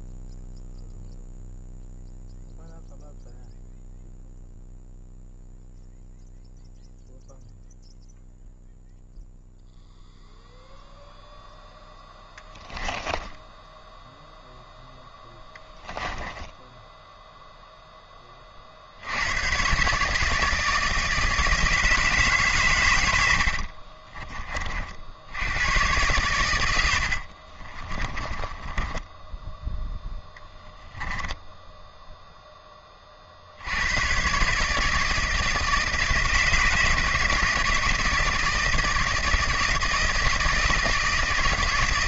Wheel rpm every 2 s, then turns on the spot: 0, 0, 0, 0, 0, 0, 10, 0, 0, 50, 160, 130, 40, 90, 20, 10, 10, 150, 160, 160, 160.
28-32